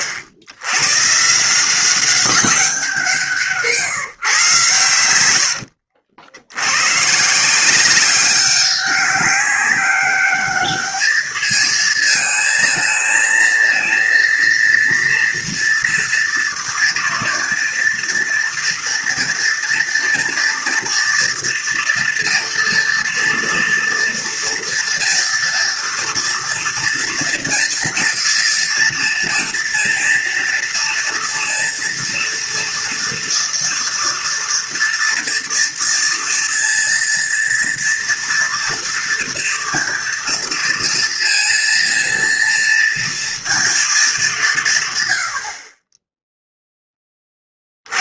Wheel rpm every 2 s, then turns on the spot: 100, 190, 140, 80, 190, 210, 220, 230, 230, 230, 230, 240, 230, 230, 230, 230, 230, 240, 230, 230, 230, 230, 170, 0.
none